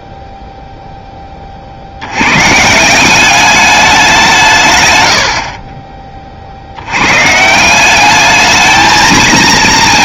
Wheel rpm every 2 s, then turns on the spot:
0, 160, 180, 90, 220.
none